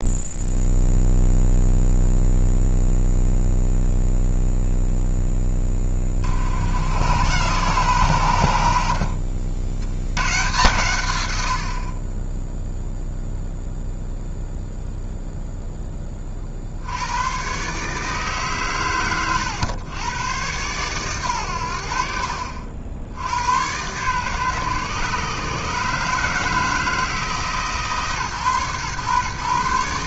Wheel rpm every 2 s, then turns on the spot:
0, 0, 0, 70, 80, 130, 0, 0, 60, 130, 120, 60, 130, 160, 130.
none